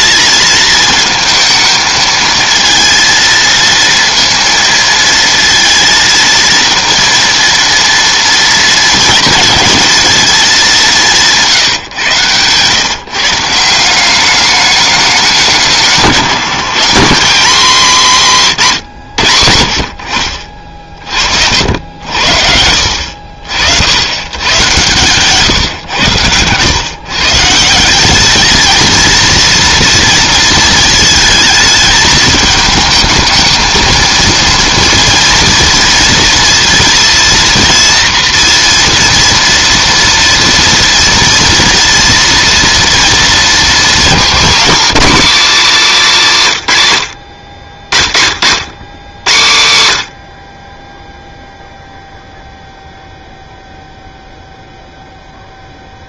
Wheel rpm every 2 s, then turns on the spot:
220, 230, 230, 230, 230, 210, 120, 210, 180, 160, 50, 60, 120, 110, 220, 230, 220, 230, 230, 230, 240, 230, 240, 150, 90, 40, 0, 0.
none